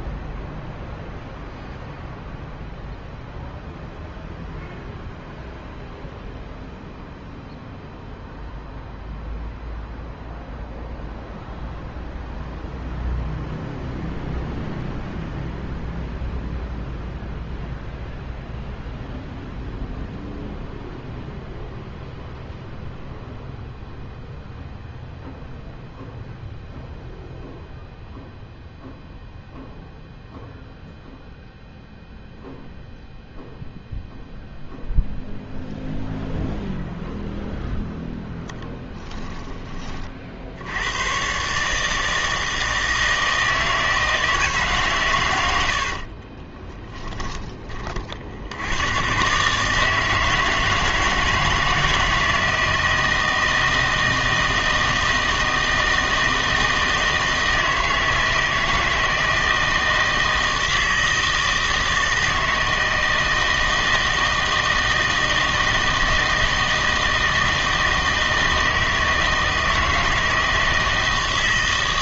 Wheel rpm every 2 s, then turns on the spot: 0, 0, 0, 0, 0, 0, 0, 0, 0, 0, 0, 0, 0, 0, 0, 0, 0, 0, 0, 10, 80, 160, 150, 20, 90, 160, 160, 160, 160, 160, 160, 160, 160, 160, 160, 160.
38-40 46-48